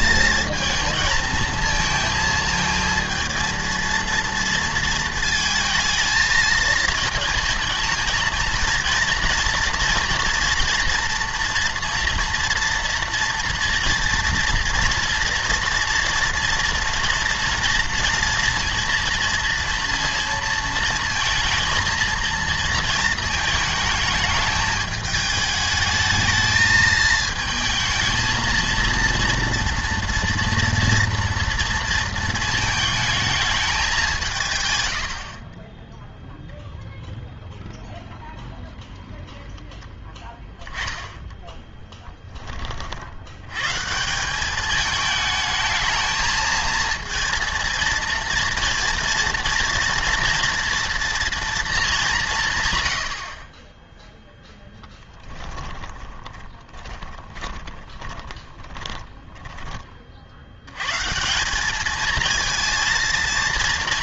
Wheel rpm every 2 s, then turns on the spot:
220, 230, 220, 220, 230, 230, 230, 230, 230, 230, 230, 230, 210, 220, 230, 240, 220, 110, 0, 0, 10, 50, 210, 220, 230, 230, 120, 10, 20, 20, 110, 230.
54-60